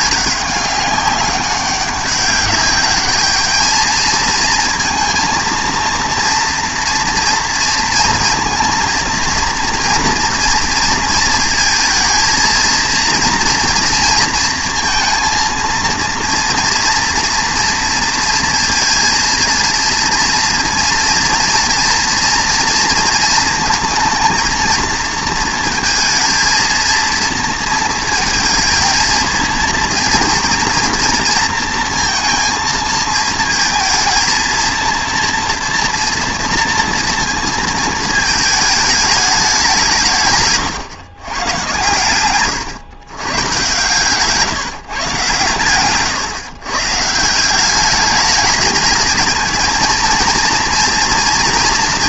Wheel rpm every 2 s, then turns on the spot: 200, 210, 220, 230, 230, 230, 230, 230, 230, 230, 230, 230, 230, 230, 230, 230, 230, 230, 230, 220, 130, 130, 140, 140, 220, 240.
none